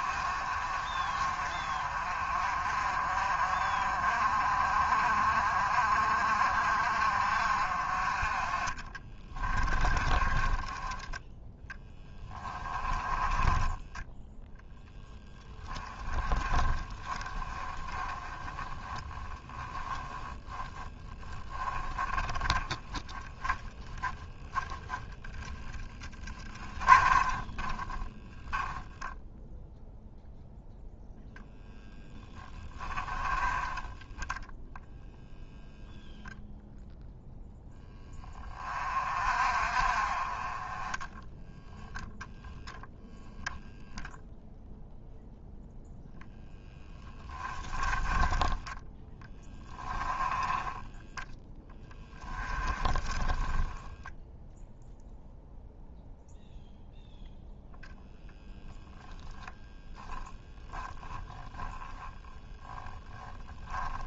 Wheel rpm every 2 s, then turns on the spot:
40, 40, 40, 50, 20, 10, 20, 10, 20, 10, 20, 20, 10, 20, 0, 0, 20, 0, 0, 30, 10, 10, 0, 10, 10, 20, 10, 0, 0, 0, 10, 10.
8-14 16-24 26-28 32-34 46-48 52-54 60-62